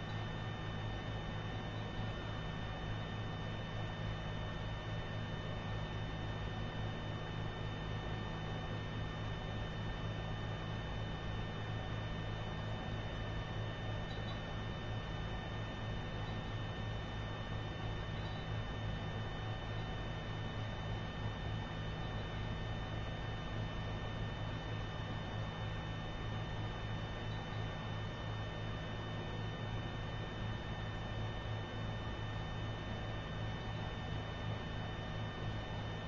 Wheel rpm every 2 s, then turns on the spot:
0, 0, 0, 0, 0, 0, 0, 0, 0, 0, 0, 0, 0, 0, 0, 0, 0, 0.
none